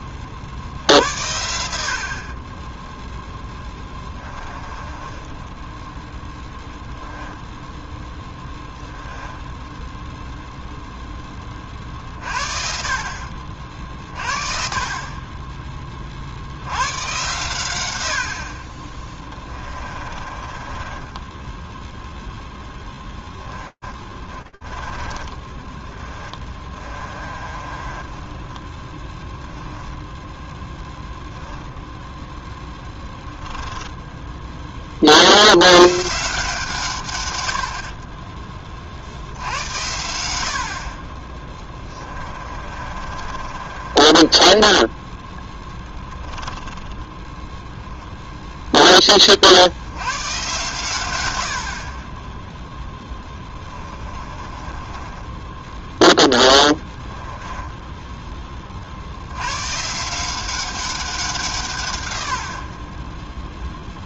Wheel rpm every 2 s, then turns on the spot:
70, 10, 20, 0, 20, 0, 50, 40, 100, 20, 30, 0, 10, 20, 0, 0, 10, 30, 140, 20, 50, 30, 10, 20, 10, 120, 10, 20, 10, 50, 190, 60.
4-6 8-10 20-22 24-28 32-34 42-48 52-58